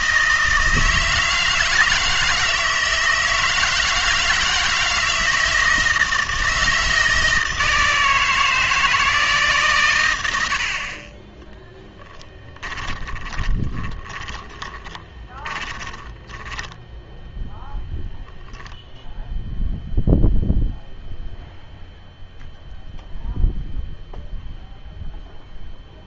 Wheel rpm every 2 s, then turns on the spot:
160, 160, 160, 160, 160, 60, 20, 20, 10, 0, 0, 0, 0.
12-18